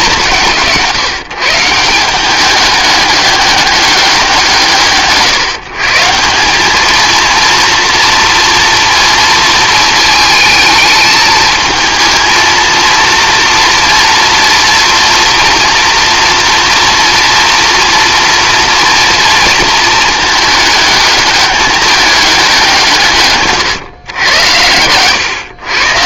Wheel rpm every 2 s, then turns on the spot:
160, 200, 160, 200, 230, 220, 230, 240, 230, 230, 220, 180, 100.
none